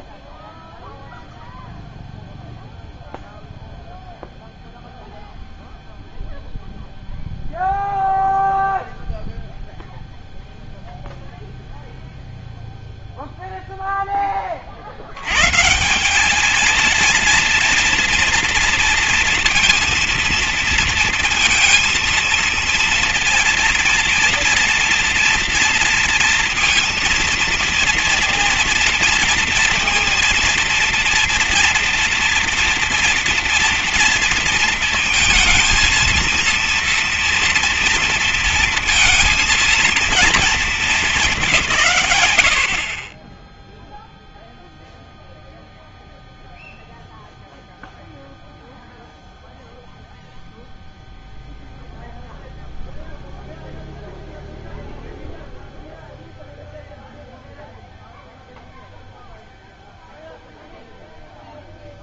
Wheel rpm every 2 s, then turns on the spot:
0, 0, 0, 0, 0, 0, 0, 30, 210, 230, 230, 230, 230, 230, 230, 230, 230, 230, 230, 230, 210, 80, 0, 0, 0, 0, 0, 0, 0, 0, 0.
none